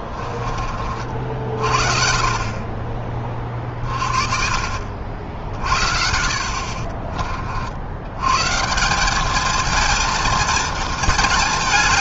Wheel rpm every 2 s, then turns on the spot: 30, 40, 50, 60, 140, 230.
6-8